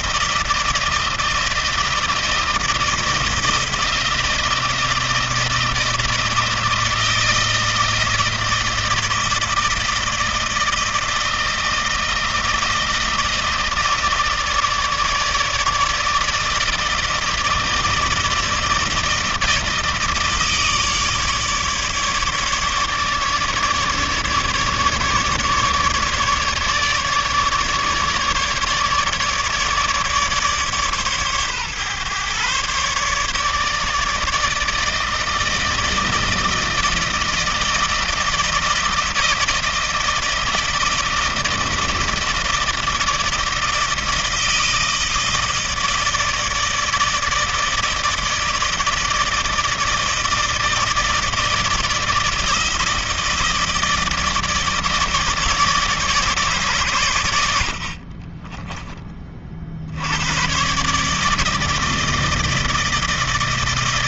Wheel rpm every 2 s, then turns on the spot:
170, 160, 160, 160, 160, 160, 160, 160, 160, 160, 150, 150, 150, 150, 150, 140, 130, 160, 160, 160, 160, 160, 160, 160, 160, 160, 160, 160, 150, 20, 120, 160.
58-60